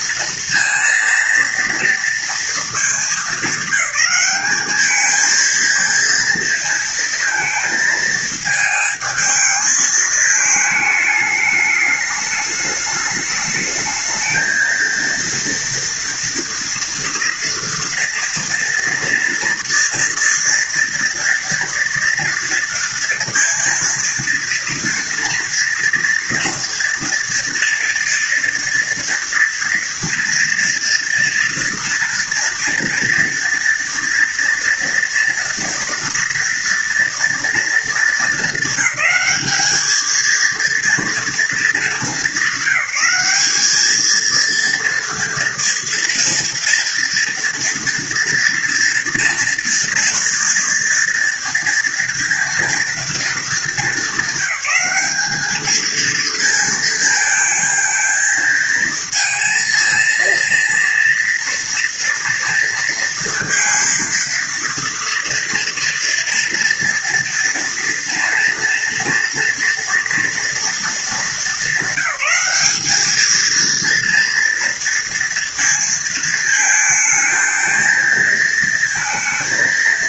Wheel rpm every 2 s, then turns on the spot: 230, 230, 200, 230, 220, 220, 210, 220, 230, 230, 230, 230, 230, 230, 240, 230, 230, 230, 230, 200, 230, 200, 230, 230, 230, 230, 230, 200, 220, 220, 230, 230, 230, 230, 230, 230, 210, 230, 230, 230.
none